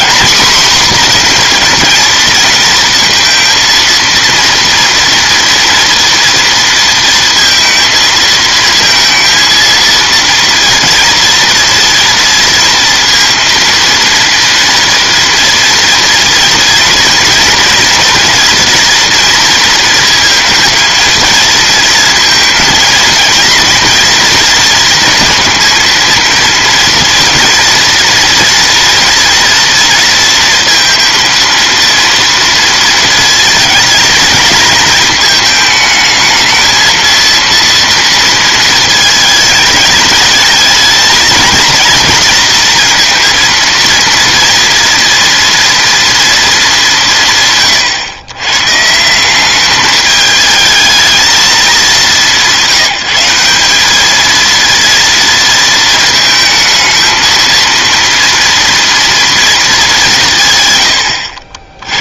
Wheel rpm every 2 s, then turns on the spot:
250, 230, 230, 230, 220, 230, 230, 230, 230, 240, 230, 230, 230, 230, 230, 230, 230, 230, 220, 230, 220, 230, 230, 210, 150, 220, 190, 230, 220, 230, 100.
none